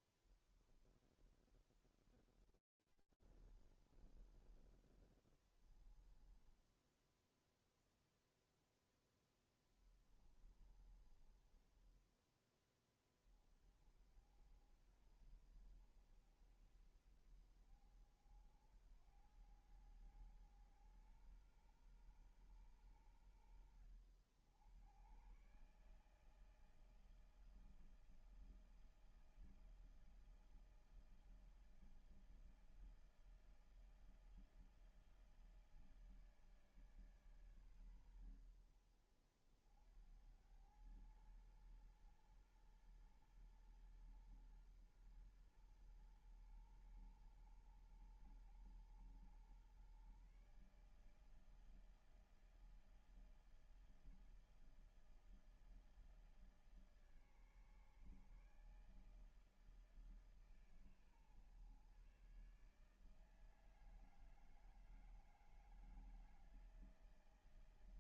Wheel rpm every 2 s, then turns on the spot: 0, 20, 10, 0, 10, 20, 30, 70, 70, 90, 120, 90, 110, 160, 160, 160, 160, 160, 150, 70, 100, 120, 120, 120, 120, 150, 160, 160, 150, 150, 150, 150, 160, 160.
4-6 8-12